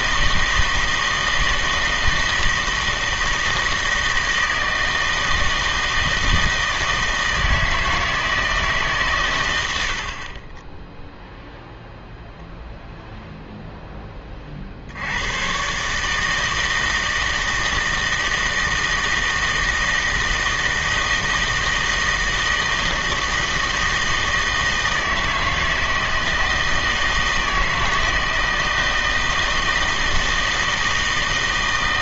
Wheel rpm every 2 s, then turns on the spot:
160, 160, 160, 160, 150, 10, 0, 50, 160, 160, 160, 160, 160, 160, 160, 160.
none